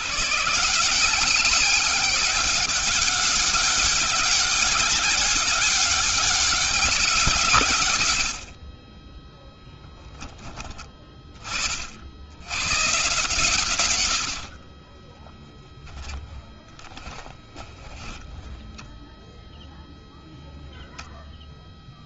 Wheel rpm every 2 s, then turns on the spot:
160, 190, 190, 190, 40, 20, 130, 30, 20, 10, 0.
14-18